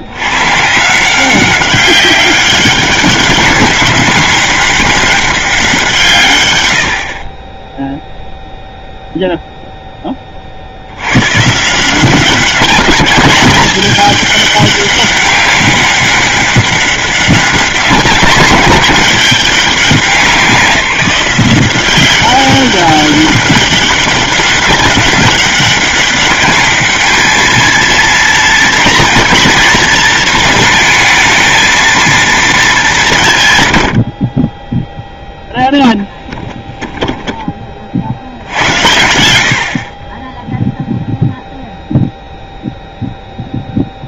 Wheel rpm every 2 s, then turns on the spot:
160, 200, 200, 90, 0, 70, 200, 200, 190, 200, 180, 190, 200, 210, 230, 220, 200, 0, 20, 100, 0, 0.
36-38